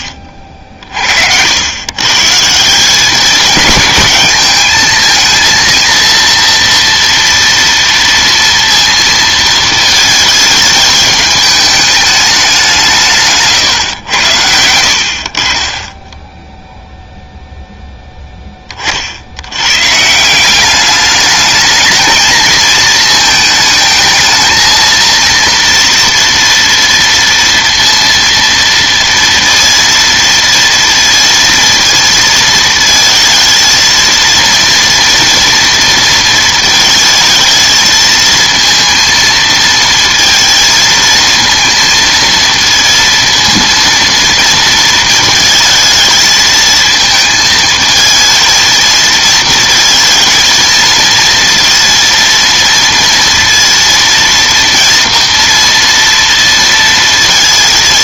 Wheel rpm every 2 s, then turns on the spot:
40, 170, 220, 230, 230, 210, 180, 70, 0, 30, 190, 220, 230, 230, 230, 230, 220, 230, 220, 230, 230, 230, 230, 220, 230, 230, 230, 230, 230.
none